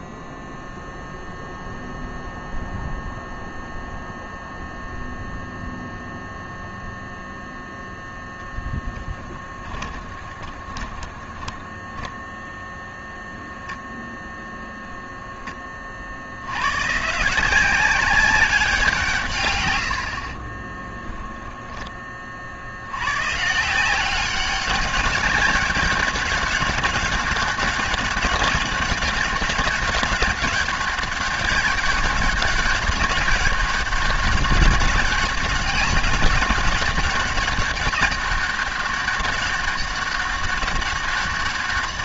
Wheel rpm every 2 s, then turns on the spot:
0, 0, 0, 0, 10, 20, 0, 0, 130, 180, 20, 80, 190, 200, 200, 200, 200, 200, 200, 200, 200.
8-12 20-22